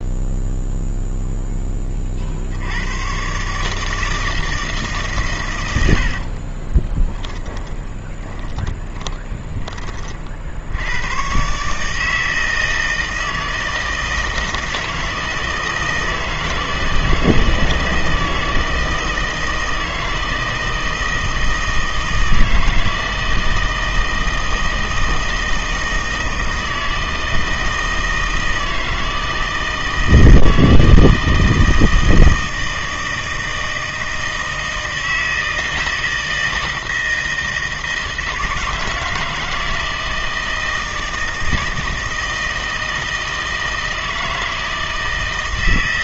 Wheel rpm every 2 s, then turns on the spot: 0, 80, 160, 30, 20, 80, 160, 160, 160, 160, 160, 160, 160, 160, 160, 160, 160, 160, 160, 160, 160, 160, 160.
6-10